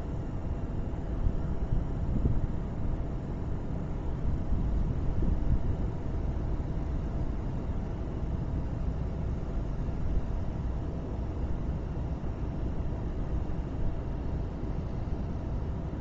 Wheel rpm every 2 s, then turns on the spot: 0, 0, 0, 0, 0, 0, 0, 0.
none